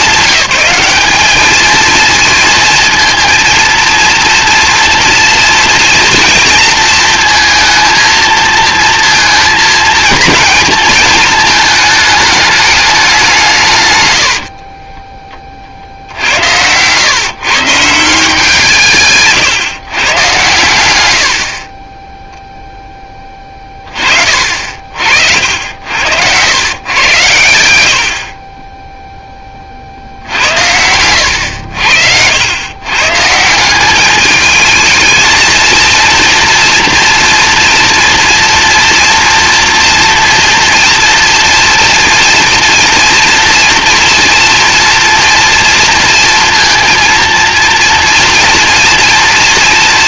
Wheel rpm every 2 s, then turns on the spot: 200, 230, 230, 230, 230, 230, 210, 40, 90, 160, 90, 0, 50, 110, 20, 80, 120, 210, 240, 230, 230, 230, 230, 230, 230.
14-16